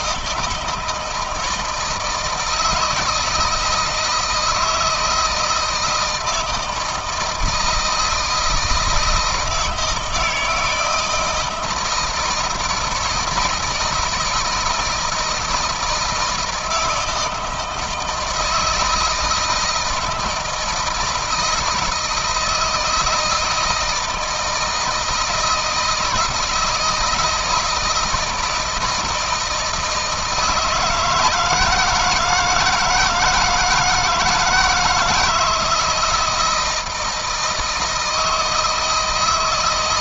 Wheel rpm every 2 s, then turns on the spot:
160, 160, 160, 160, 160, 160, 160, 160, 160, 160, 170, 160, 170, 160, 160, 160, 160, 160, 160, 160.
none